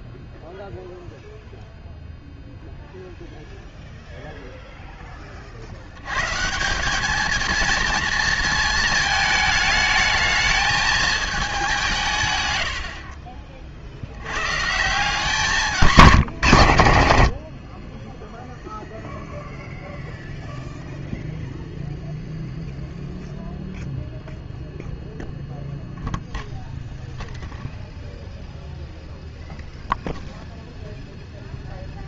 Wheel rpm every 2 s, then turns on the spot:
0, 0, 10, 190, 220, 220, 90, 160, 70, 0, 0, 0, 0, 0, 0, 0.
12-14